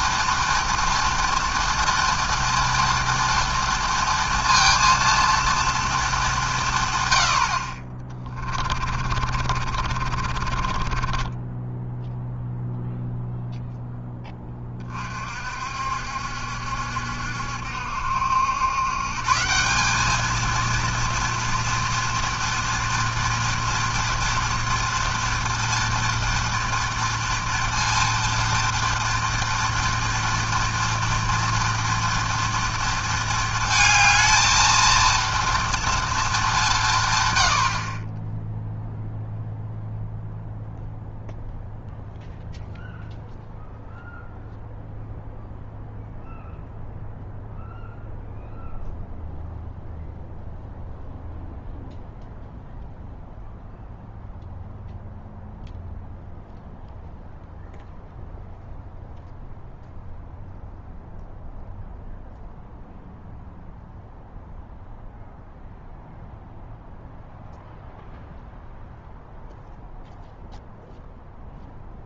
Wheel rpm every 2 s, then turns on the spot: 230, 240, 230, 160, 30, 30, 0, 30, 70, 120, 230, 240, 230, 230, 230, 230, 230, 220, 180, 0, 0, 0, 0, 0, 0, 0, 0, 0, 0, 0, 0, 0, 0, 0, 0, 0.
8-12